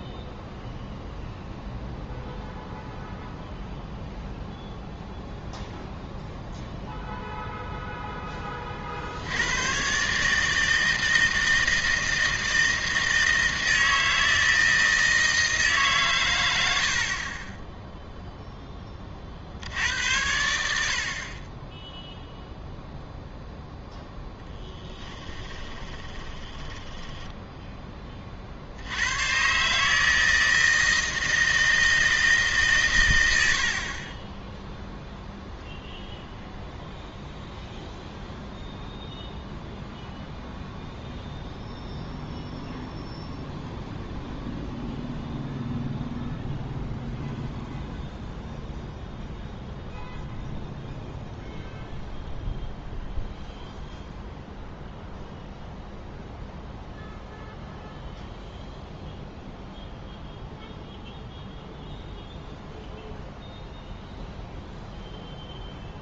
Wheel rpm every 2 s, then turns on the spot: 0, 0, 0, 0, 40, 160, 160, 160, 100, 10, 80, 0, 10, 10, 70, 160, 140, 0, 0, 0, 0, 0, 0, 0, 0, 0, 0, 0, 0, 0, 0, 0, 0.
24-28